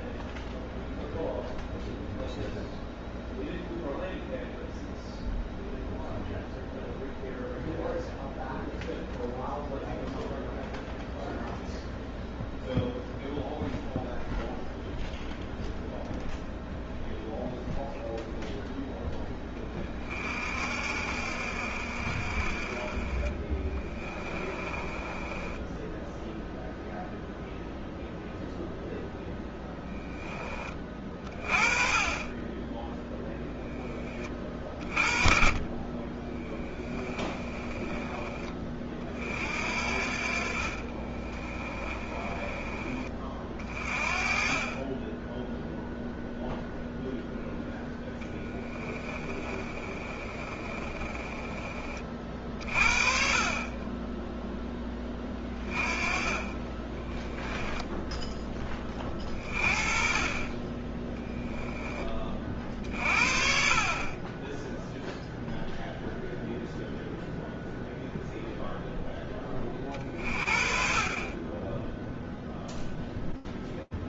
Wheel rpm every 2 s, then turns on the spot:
0, 0, 0, 0, 0, 0, 0, 0, 0, 10, 60, 30, 20, 0, 0, 30, 10, 30, 20, 40, 30, 30, 30, 0, 20, 30, 40, 10, 20, 20, 20, 40, 10, 0, 0, 40, 0.
22-26 36-38 40-42 48-52 56-58